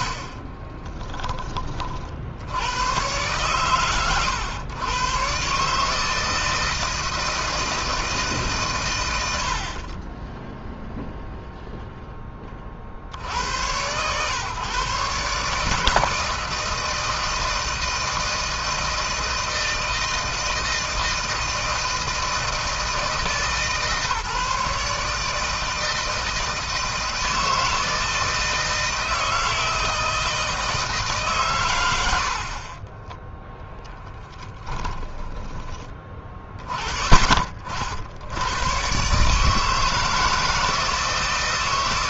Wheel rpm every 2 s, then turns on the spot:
30, 90, 100, 160, 140, 10, 40, 120, 160, 160, 160, 160, 150, 160, 160, 160, 50, 20, 30, 110, 160.
0-2 32-36